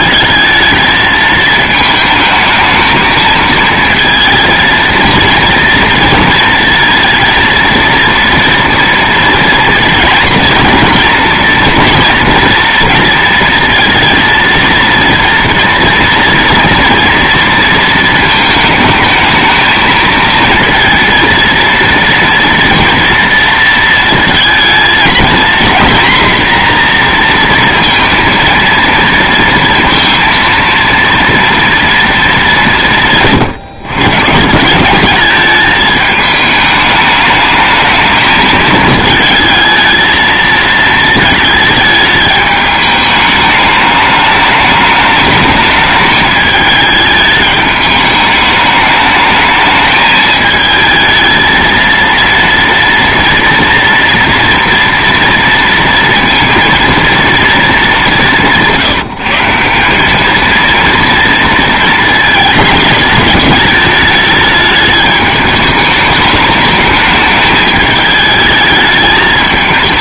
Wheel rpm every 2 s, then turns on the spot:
220, 220, 230, 230, 230, 240, 230, 230, 230, 220, 230, 230, 230, 240, 230, 230, 190, 180, 210, 220, 220, 210, 210, 220, 210, 220, 230, 230, 230, 170, 230, 220, 210, 210, 210.
none